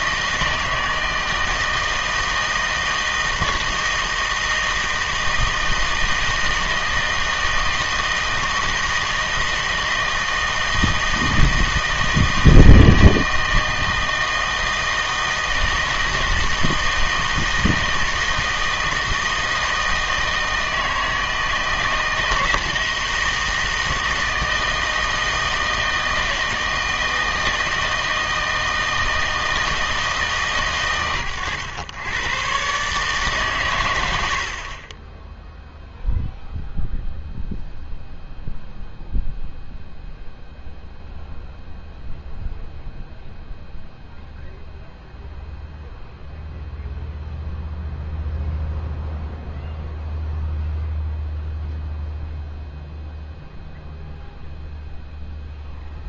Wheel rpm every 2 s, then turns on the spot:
160, 160, 160, 160, 160, 160, 160, 160, 160, 160, 160, 160, 160, 160, 160, 130, 140, 30, 0, 0, 0, 0, 0, 0, 0, 0, 0, 0.
34-36